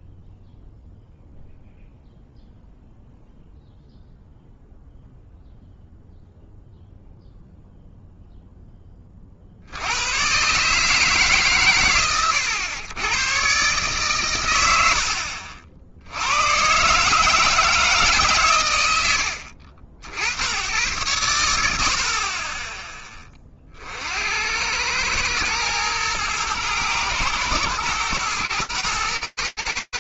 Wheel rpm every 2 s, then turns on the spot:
0, 0, 0, 0, 0, 70, 120, 130, 70, 160, 70, 50, 60, 110, 110.
none